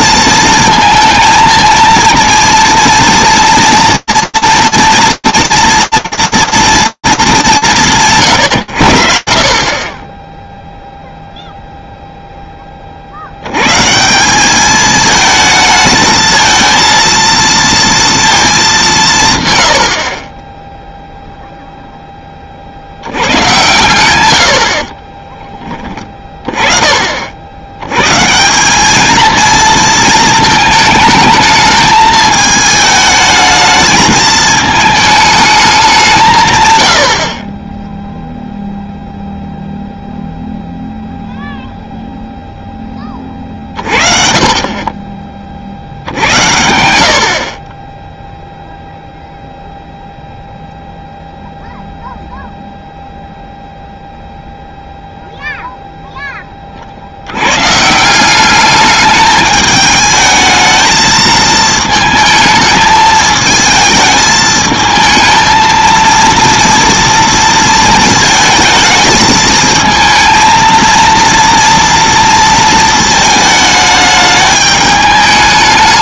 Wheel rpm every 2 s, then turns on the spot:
230, 230, 230, 150, 0, 0, 110, 220, 230, 90, 0, 90, 20, 50, 220, 220, 220, 220, 60, 0, 0, 30, 70, 20, 0, 0, 0, 0, 60, 210, 220, 220, 220, 230, 220, 230, 220, 210.
24-26